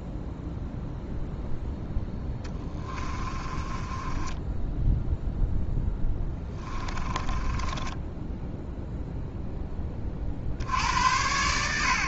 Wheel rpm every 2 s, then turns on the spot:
0, 30, 10, 20, 0, 90.
2-8